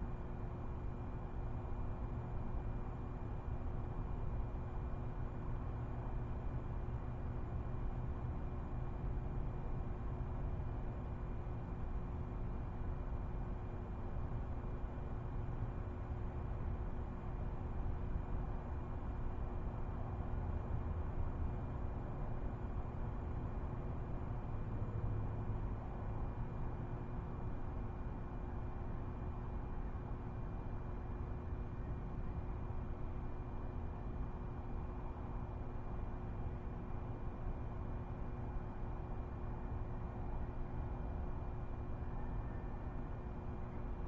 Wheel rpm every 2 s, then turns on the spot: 0, 0, 0, 0, 0, 0, 0, 0, 0, 0, 0, 0, 0, 0, 0, 0, 0, 0, 0, 0, 0, 0.
none